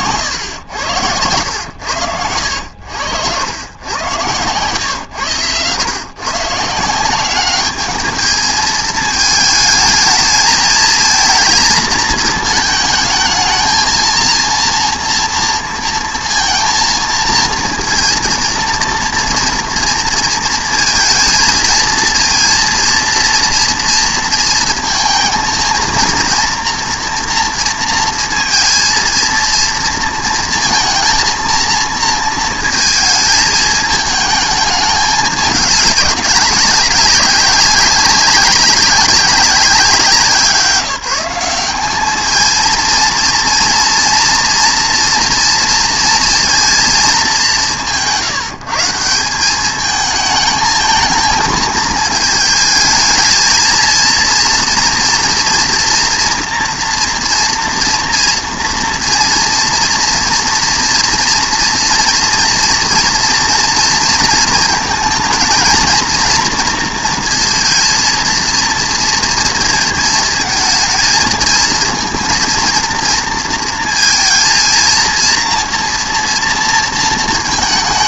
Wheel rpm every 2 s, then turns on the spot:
100, 90, 110, 160, 220, 220, 220, 230, 230, 230, 230, 230, 230, 230, 230, 230, 220, 210, 190, 200, 180, 220, 240, 230, 160, 220, 220, 230, 230, 240, 240, 230, 230, 230, 230, 220, 230, 230, 230.
none